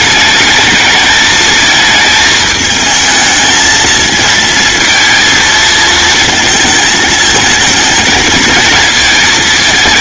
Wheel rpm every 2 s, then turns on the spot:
220, 220, 230, 220, 220.
none